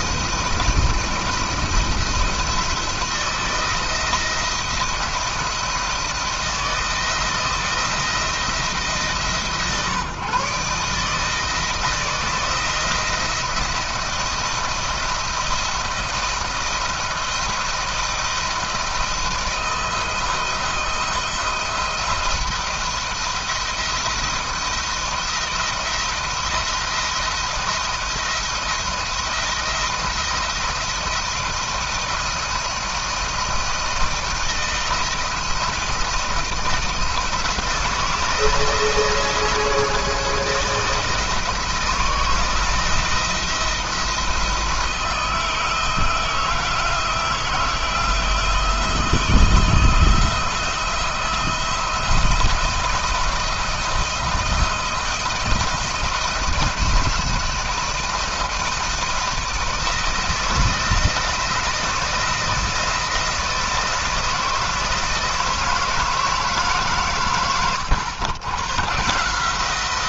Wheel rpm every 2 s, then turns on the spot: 170, 170, 170, 170, 160, 150, 170, 170, 160, 160, 160, 170, 170, 170, 170, 170, 160, 170, 160, 170, 160, 170, 160, 170, 160, 170, 170, 170, 170, 160, 170, 170, 160, 140, 120.
none